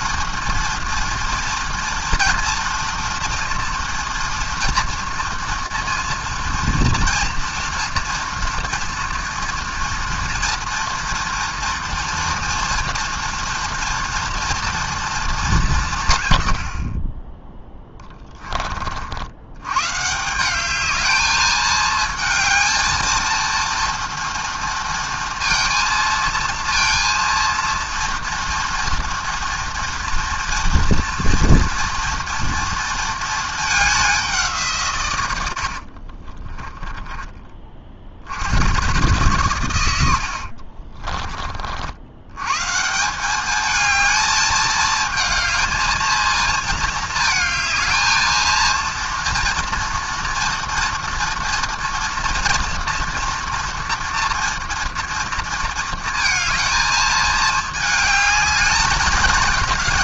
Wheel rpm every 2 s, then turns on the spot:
230, 230, 230, 230, 230, 230, 240, 230, 170, 20, 120, 220, 230, 220, 230, 240, 230, 200, 40, 60, 90, 90, 220, 220, 220, 230, 230, 230, 230, 220.
18-20 36-38